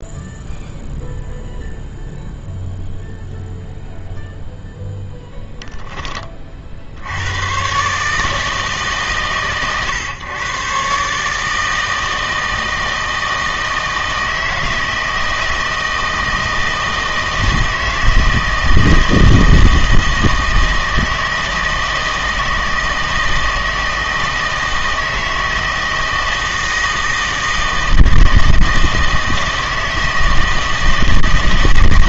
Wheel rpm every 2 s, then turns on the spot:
0, 0, 0, 50, 150, 130, 160, 160, 160, 160, 160, 160, 160, 160, 160, 160.
none